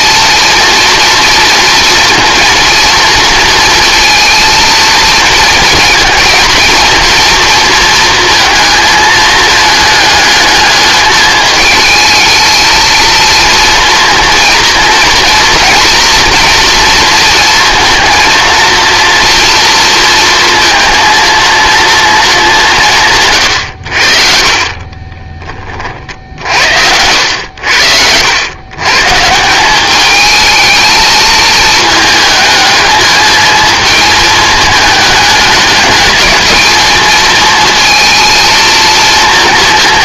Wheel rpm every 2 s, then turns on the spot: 230, 230, 230, 230, 230, 210, 220, 230, 240, 230, 230, 200, 40, 60, 90, 220, 220, 220, 220, 230.
24-28